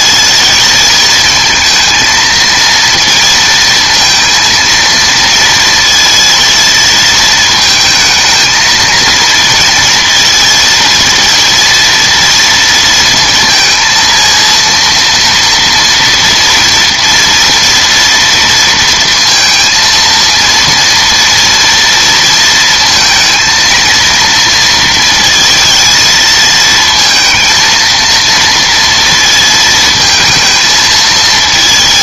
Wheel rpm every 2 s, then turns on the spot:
220, 230, 230, 230, 220, 230, 230, 230, 230, 230, 230, 230, 230, 220, 230, 230.
none